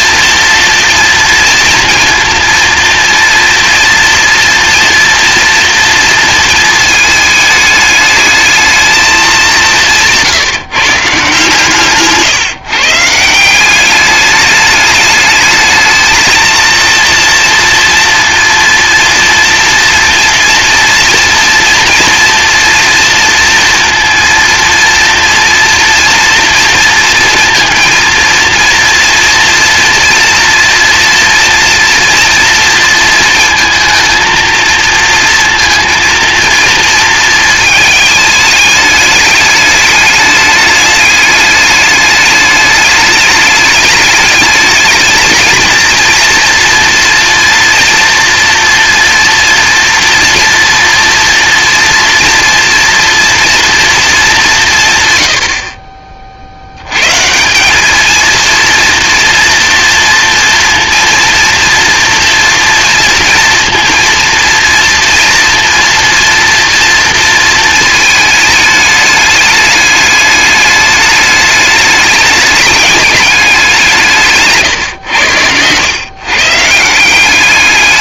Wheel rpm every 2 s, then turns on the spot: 230, 230, 230, 220, 220, 150, 140, 210, 230, 240, 230, 230, 240, 230, 230, 230, 230, 220, 230, 210, 210, 210, 220, 240, 230, 230, 230, 160, 70, 230, 230, 240, 230, 230, 210, 210, 210, 130, 160.
none